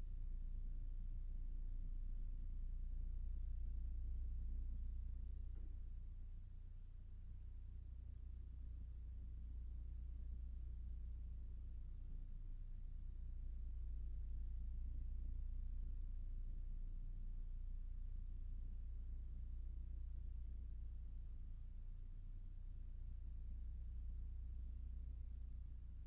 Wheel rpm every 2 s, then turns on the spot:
0, 0, 0, 0, 0, 0, 0, 0, 0, 0, 0, 0, 0.
none